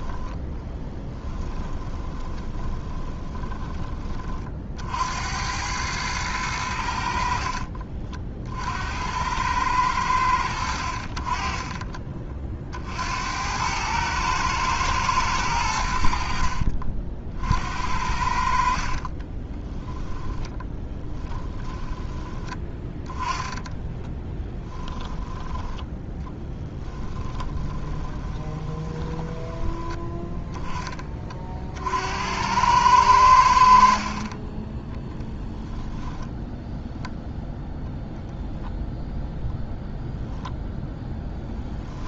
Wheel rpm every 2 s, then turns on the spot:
10, 20, 70, 80, 70, 70, 70, 110, 50, 40, 10, 10, 10, 20, 20, 20, 100, 10, 0, 0, 0.
0-4 18-22 26-30 34-36